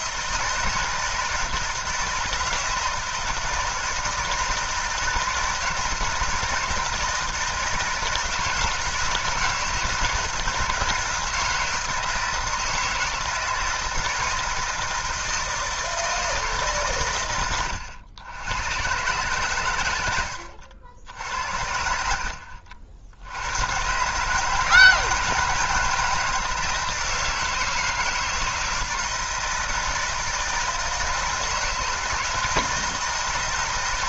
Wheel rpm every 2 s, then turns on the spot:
160, 160, 160, 160, 160, 160, 160, 160, 150, 100, 90, 60, 160, 160, 160, 160, 160.
none